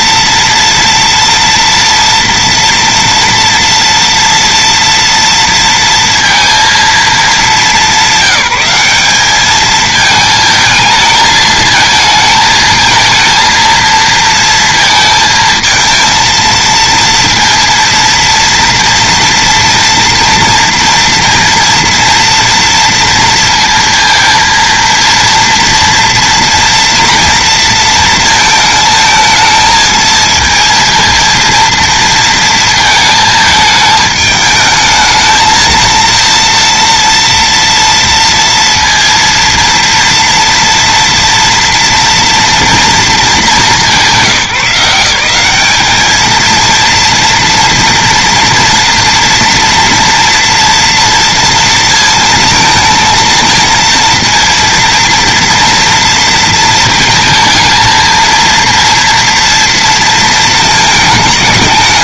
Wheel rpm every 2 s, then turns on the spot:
230, 230, 230, 210, 210, 220, 220, 220, 230, 240, 230, 230, 230, 230, 220, 230, 220, 220, 230, 230, 230, 220, 180, 230, 230, 230, 220, 230, 220, 230, 210.
none